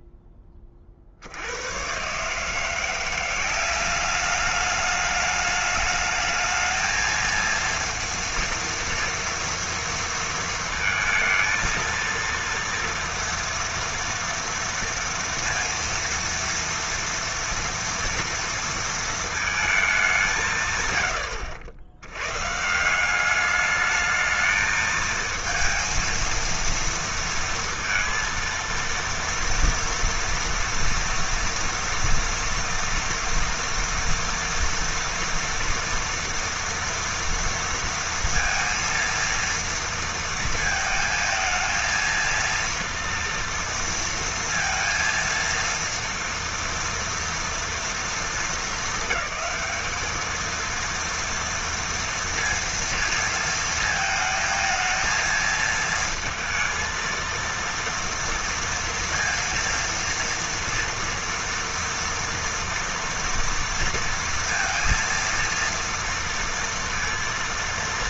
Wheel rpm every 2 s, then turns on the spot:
50, 180, 210, 220, 230, 230, 230, 230, 230, 230, 100, 180, 220, 230, 230, 230, 230, 230, 230, 230, 220, 230, 230, 240, 210, 230, 230, 220, 230, 230, 230, 230, 230, 230.
none